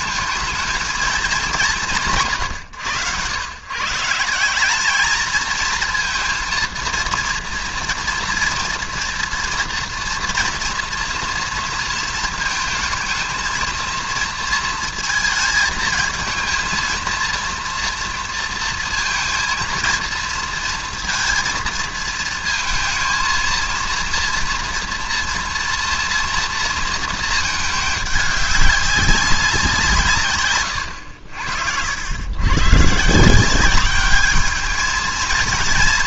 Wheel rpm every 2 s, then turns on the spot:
220, 140, 180, 230, 230, 230, 220, 230, 220, 230, 230, 220, 230, 240, 210, 120, 120, 210.
none